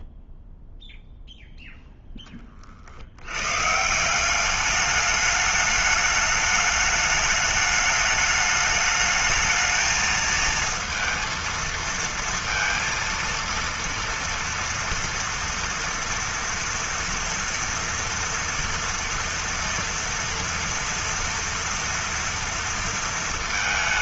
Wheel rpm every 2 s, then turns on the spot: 0, 30, 200, 210, 210, 220, 230, 230, 240, 230, 230, 230.
none